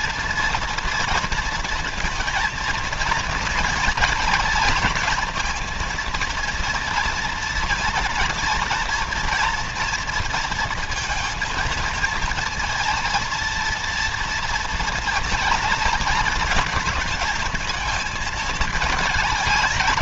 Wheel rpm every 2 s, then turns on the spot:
230, 230, 230, 230, 240, 220, 230, 230, 230, 220.
none